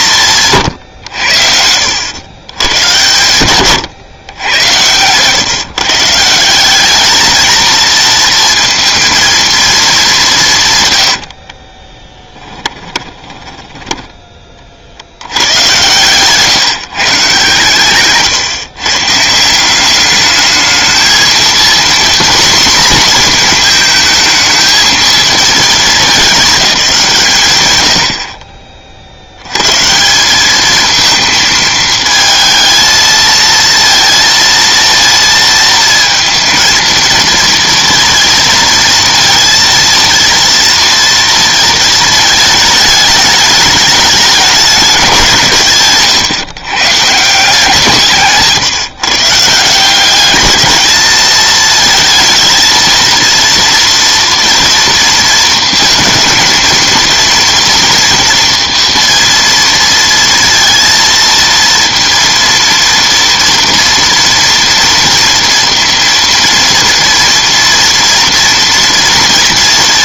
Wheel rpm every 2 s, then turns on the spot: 140, 110, 100, 180, 230, 160, 20, 30, 150, 140, 210, 240, 220, 200, 30, 200, 220, 230, 230, 230, 230, 220, 200, 110, 160, 210, 220, 230, 230, 240, 230, 230, 240, 230, 240.
12-14